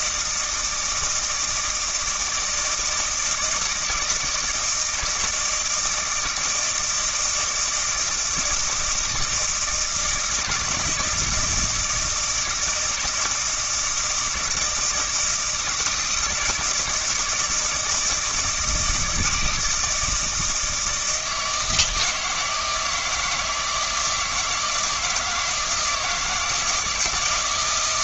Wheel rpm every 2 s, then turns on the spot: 160, 160, 170, 160, 160, 160, 160, 160, 160, 160, 160, 160, 160, 160.
none